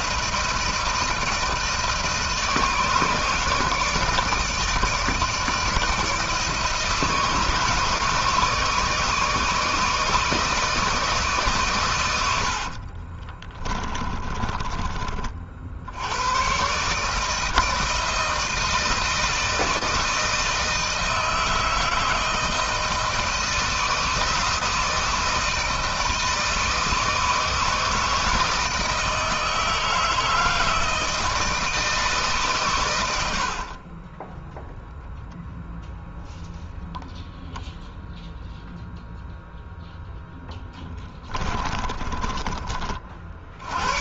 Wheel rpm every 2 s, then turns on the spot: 160, 150, 160, 160, 160, 160, 40, 40, 140, 160, 160, 160, 160, 160, 160, 160, 110, 0, 0, 0, 10, 40.
12-14 32-34 40-42